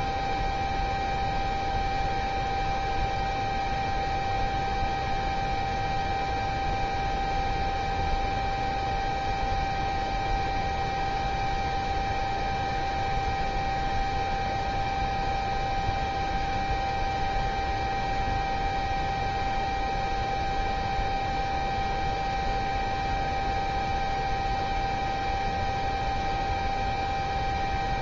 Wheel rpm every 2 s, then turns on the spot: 0, 0, 0, 0, 0, 0, 0, 0, 0, 0, 0, 0, 0, 0.
none